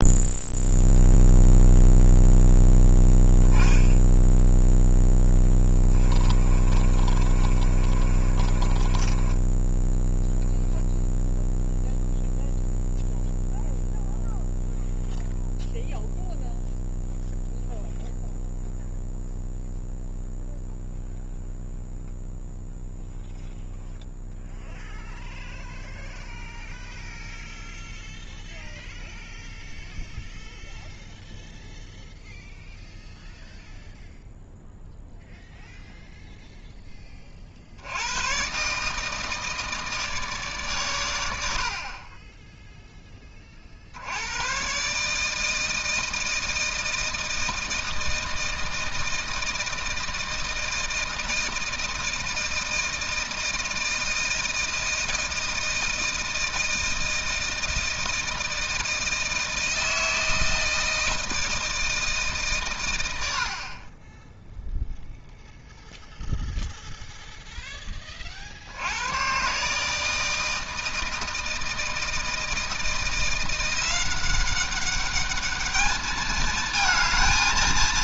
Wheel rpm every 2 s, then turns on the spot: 0, 0, 10, 30, 30, 0, 0, 0, 0, 0, 0, 0, 0, 0, 0, 0, 0, 0, 10, 140, 130, 10, 130, 160, 160, 160, 160, 160, 160, 160, 160, 140, 0, 0, 70, 160, 160, 200, 220.
6-10